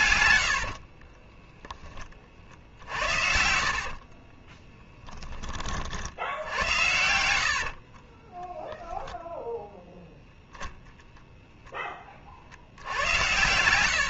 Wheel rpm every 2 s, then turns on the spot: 20, 70, 20, 80, 0, 0, 90.
0-4 6-8 12-14